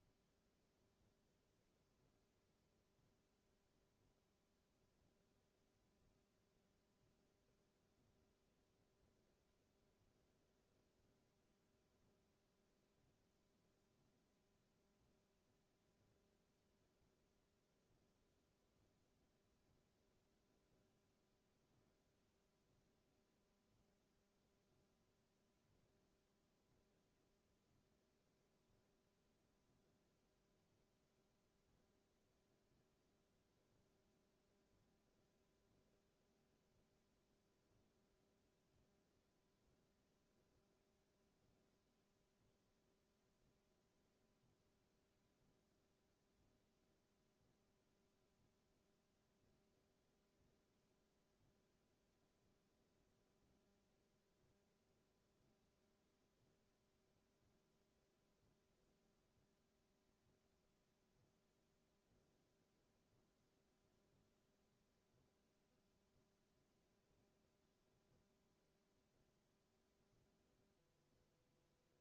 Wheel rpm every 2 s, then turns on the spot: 0, 0, 0, 0, 0, 0, 0, 0, 0, 0, 0, 0, 0, 0, 0, 0, 0, 0, 0, 0, 0, 0, 0, 0, 0, 0, 0, 0, 0, 0, 0, 0, 0, 0, 0, 0.
none